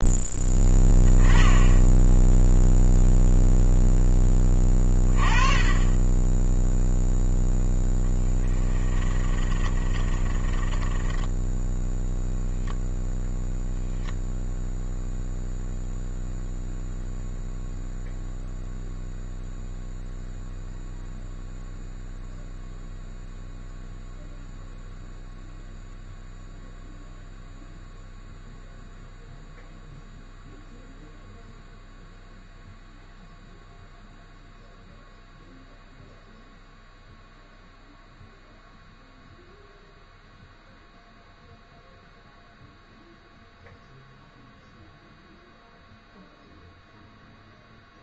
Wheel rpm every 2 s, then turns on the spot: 10, 0, 20, 0, 20, 20, 0, 0, 0, 0, 0, 0, 0, 0, 0, 0, 0, 0, 0, 0, 0, 0, 0, 0.
8-12